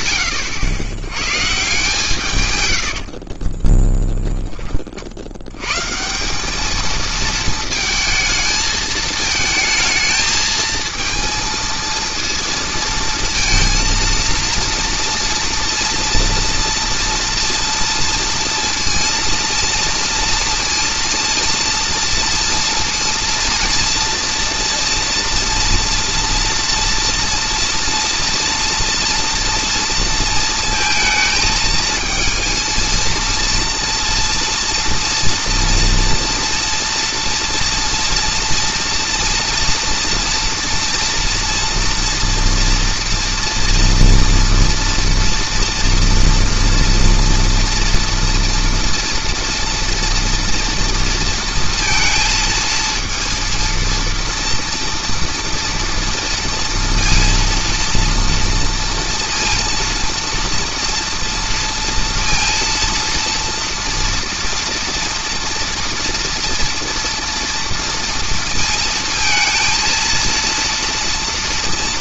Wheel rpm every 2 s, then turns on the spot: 140, 30, 70, 220, 220, 230, 230, 230, 230, 230, 230, 230, 240, 230, 240, 220, 230, 230, 230, 230, 230, 240, 230, 240, 230, 230, 230, 230, 230, 230, 230, 230, 230, 230, 230, 230.
2-4